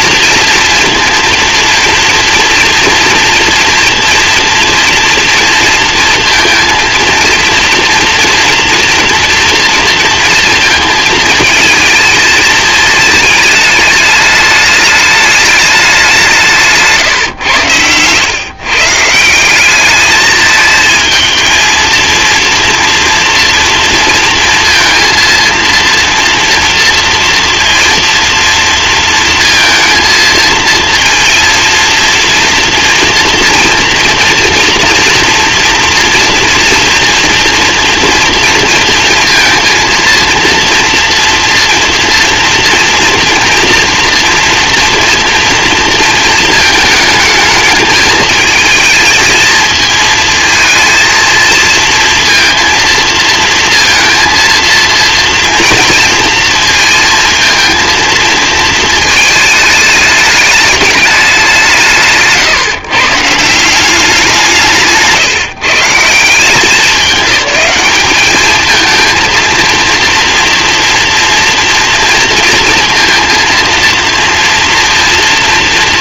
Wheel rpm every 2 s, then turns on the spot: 230, 230, 230, 230, 230, 220, 220, 210, 170, 140, 220, 230, 230, 240, 230, 230, 230, 240, 230, 230, 230, 230, 230, 220, 220, 220, 230, 230, 230, 220, 210, 140, 160, 190, 220, 230, 230, 240.
16-18